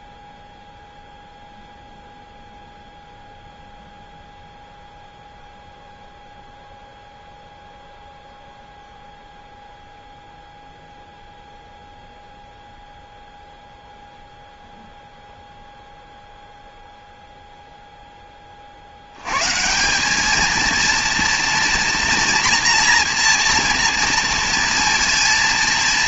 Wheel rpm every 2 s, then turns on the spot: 0, 0, 0, 0, 0, 0, 0, 0, 0, 30, 220, 240, 230.
none